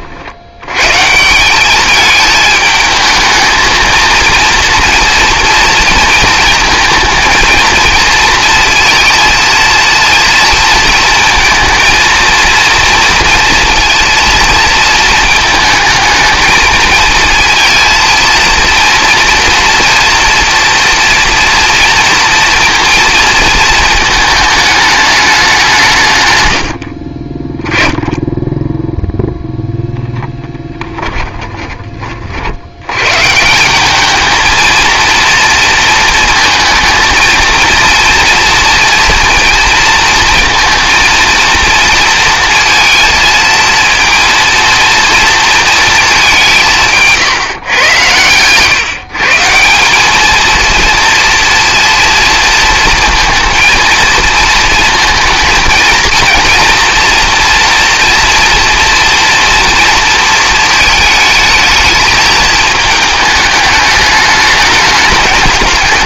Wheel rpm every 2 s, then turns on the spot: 90, 220, 230, 220, 230, 230, 230, 230, 220, 230, 230, 230, 210, 90, 10, 10, 80, 220, 220, 230, 230, 230, 230, 180, 130, 230, 230, 230, 230, 230, 220, 220, 210.
30-32